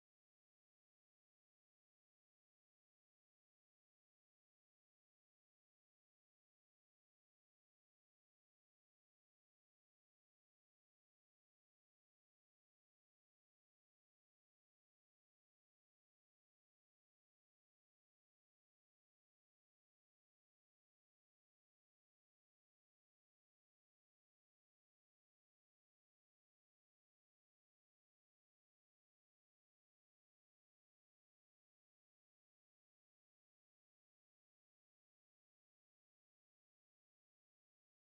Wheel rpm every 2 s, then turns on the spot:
0, 0, 0, 0, 0, 0, 0, 0, 0, 0, 0, 0, 0, 0, 0, 0, 0, 0, 0.
none